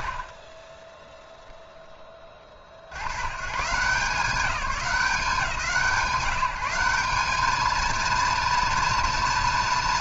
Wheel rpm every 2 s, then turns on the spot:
40, 190, 180, 230, 230.
none